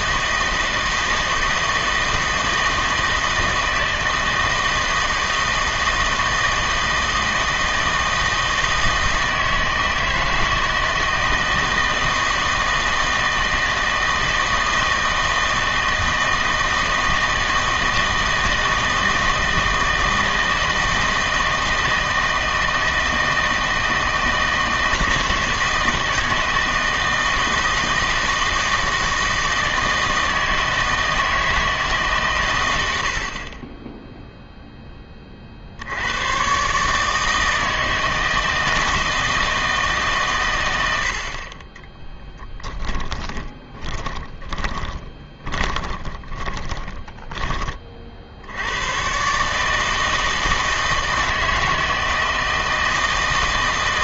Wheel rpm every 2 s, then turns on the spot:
160, 160, 160, 160, 160, 160, 160, 160, 160, 160, 160, 160, 160, 160, 160, 160, 100, 10, 130, 160, 90, 20, 20, 20, 90, 160, 160.
42-48